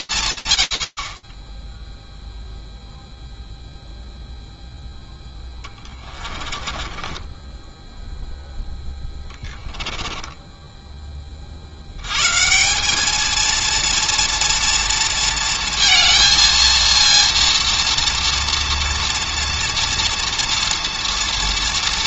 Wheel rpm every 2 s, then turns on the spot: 160, 0, 0, 20, 10, 20, 210, 230, 230, 230, 230.
6-10